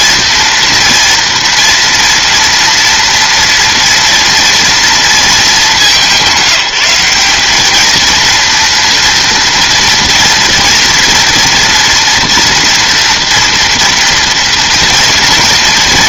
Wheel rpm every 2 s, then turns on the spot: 240, 230, 230, 190, 230, 230, 230, 230.
none